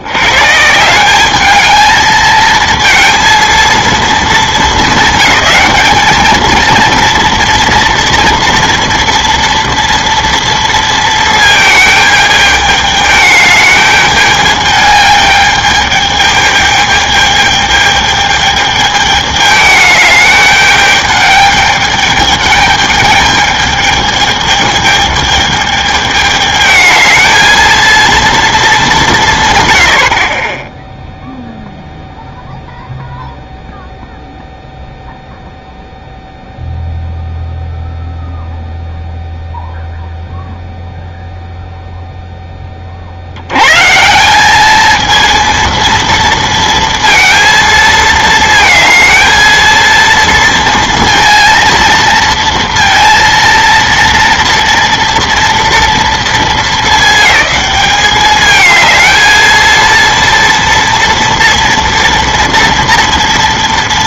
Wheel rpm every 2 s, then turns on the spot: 150, 230, 210, 230, 230, 230, 210, 210, 210, 210, 210, 210, 210, 210, 210, 10, 0, 0, 0, 0, 0, 30, 210, 230, 220, 230, 230, 230, 220, 220, 230, 230.
none